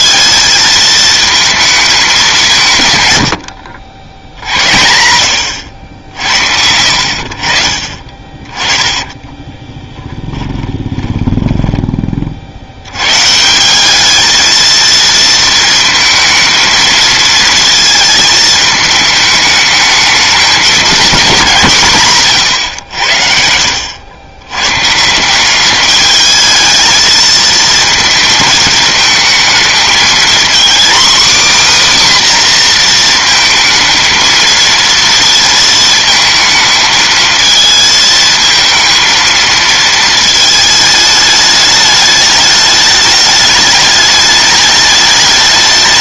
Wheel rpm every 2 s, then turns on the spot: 220, 150, 90, 70, 20, 10, 80, 230, 230, 220, 210, 100, 140, 220, 220, 260, 240, 230, 220, 230, 220, 210, 210.
8-12